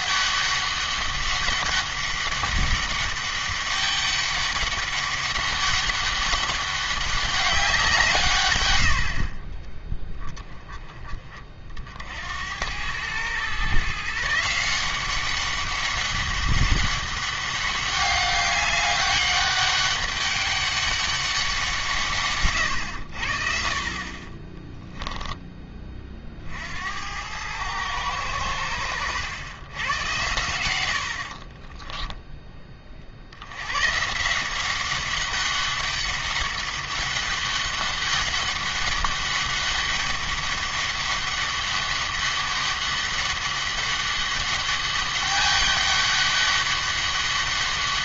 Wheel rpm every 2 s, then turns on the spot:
200, 200, 200, 200, 100, 20, 90, 170, 200, 200, 200, 120, 10, 70, 100, 90, 20, 180, 200, 200, 200, 200, 200, 200.
none